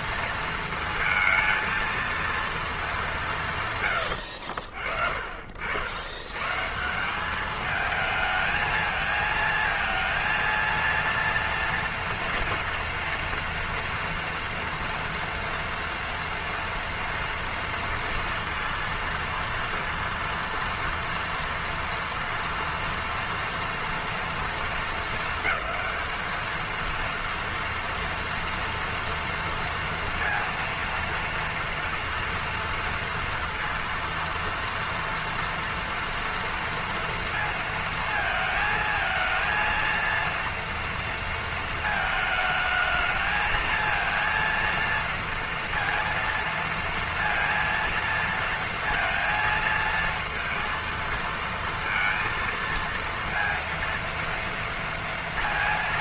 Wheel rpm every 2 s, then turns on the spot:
230, 230, 120, 100, 220, 230, 230, 230, 240, 230, 230, 230, 230, 220, 230, 230, 230, 230, 230, 220, 230, 220, 230, 230, 230, 230, 230, 230.
4-6